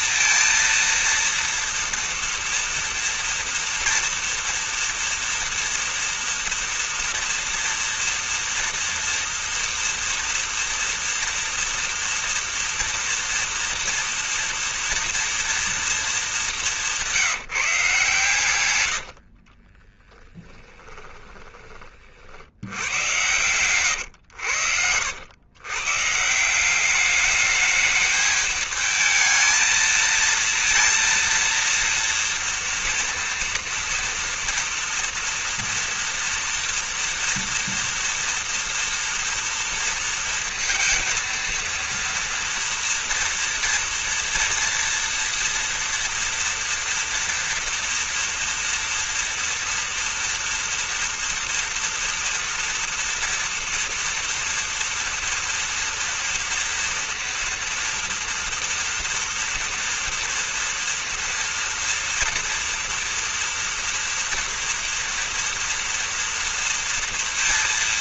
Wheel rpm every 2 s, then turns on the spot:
230, 230, 230, 230, 230, 230, 230, 230, 220, 130, 20, 60, 110, 150, 220, 230, 240, 230, 230, 230, 230, 230, 230, 230, 240, 230, 230, 230, 230, 230, 230, 230, 230, 230.
20-22